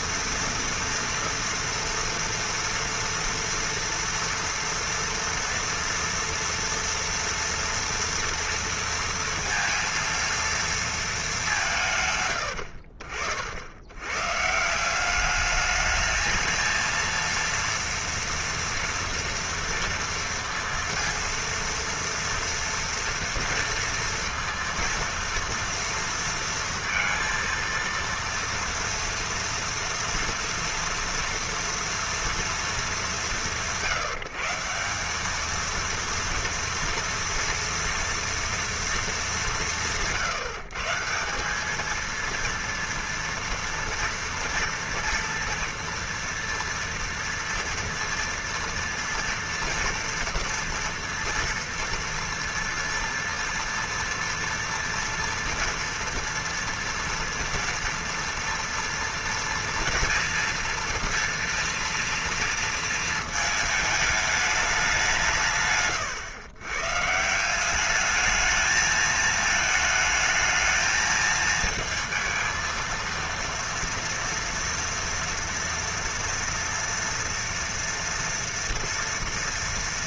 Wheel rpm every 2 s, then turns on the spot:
240, 230, 240, 230, 230, 230, 70, 160, 230, 230, 230, 230, 230, 230, 230, 240, 210, 170, 230, 230, 150, 230, 230, 240, 240, 230, 230, 230, 230, 230, 230, 230, 200, 130, 220, 220, 230, 230, 240, 230.
none